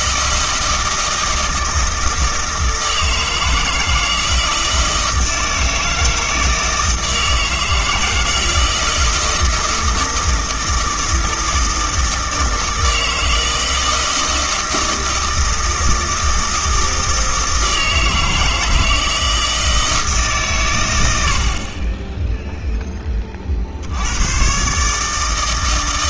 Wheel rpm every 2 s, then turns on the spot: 160, 160, 160, 160, 160, 160, 160, 160, 160, 160, 120, 10, 130.
none